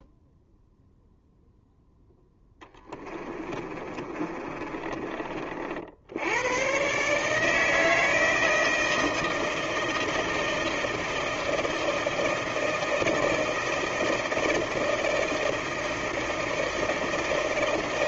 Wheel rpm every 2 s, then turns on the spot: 0, 20, 30, 120, 160, 160, 160, 160, 160.
2-6